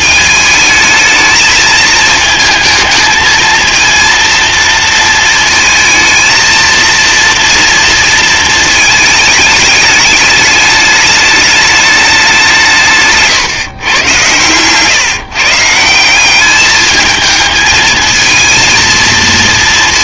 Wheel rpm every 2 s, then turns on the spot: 220, 220, 230, 230, 220, 210, 170, 120, 210, 220.
none